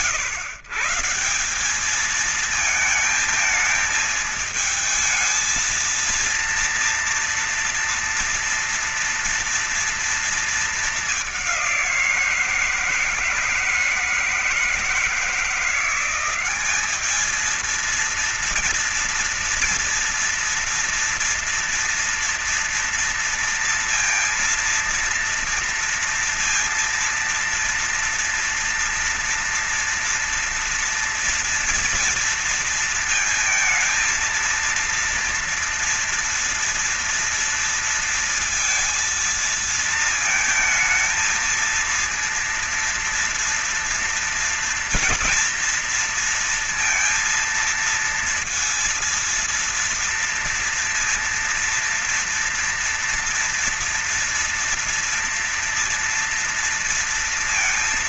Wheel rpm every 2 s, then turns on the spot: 130, 220, 220, 230, 230, 220, 170, 160, 200, 230, 230, 230, 230, 230, 240, 230, 230, 230, 230, 230, 220, 230, 230, 230, 230, 230, 230, 240, 230.
none